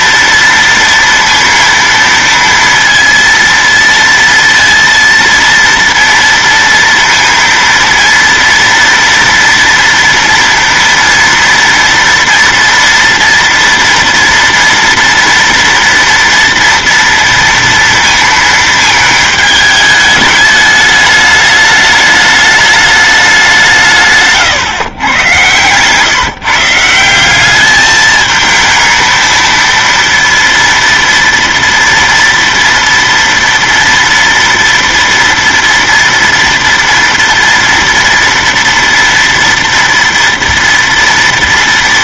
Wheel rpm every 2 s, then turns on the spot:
230, 230, 230, 230, 230, 230, 230, 230, 230, 220, 210, 210, 130, 160, 220, 230, 230, 240, 240, 230, 230.
none